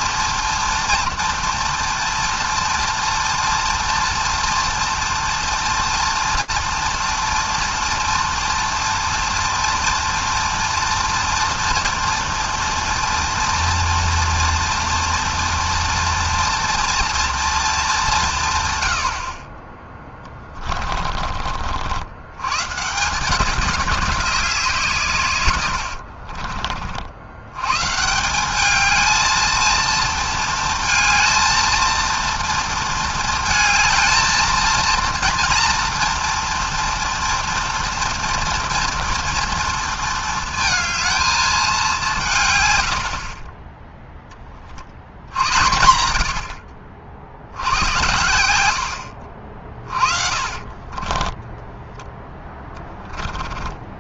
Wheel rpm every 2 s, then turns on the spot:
230, 230, 240, 240, 230, 230, 240, 240, 240, 120, 30, 110, 190, 50, 190, 230, 230, 230, 230, 230, 230, 130, 30, 80, 90, 30, 10.
20-22 26-28 50-52